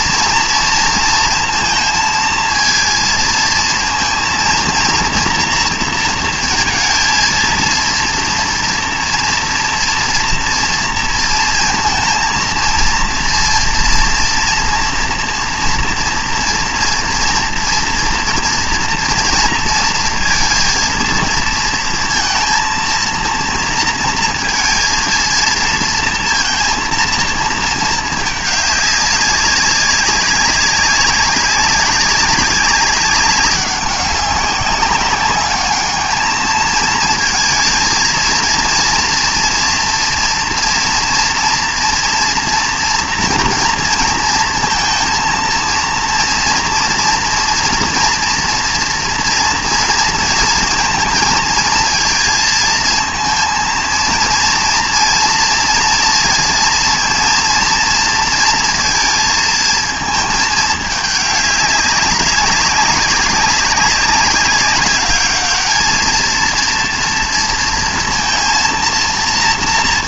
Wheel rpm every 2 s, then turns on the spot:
230, 230, 230, 230, 230, 230, 230, 230, 230, 240, 230, 230, 230, 230, 210, 200, 190, 200, 220, 230, 230, 230, 230, 230, 240, 230, 220, 230, 230, 230, 210, 200, 200, 240, 230.
none